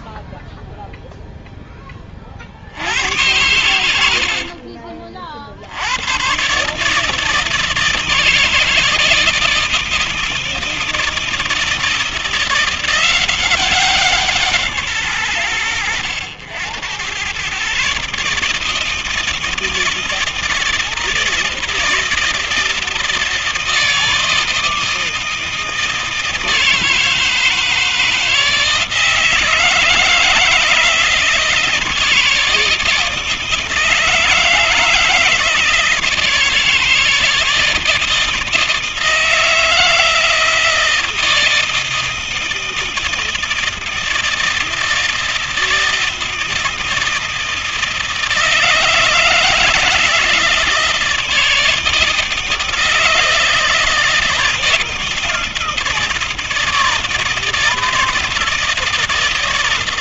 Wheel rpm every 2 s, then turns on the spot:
0, 60, 60, 130, 160, 160, 170, 170, 90, 150, 160, 160, 160, 160, 160, 160, 160, 160, 160, 160, 160, 160, 160, 160, 160, 170, 160, 160, 160, 160.
none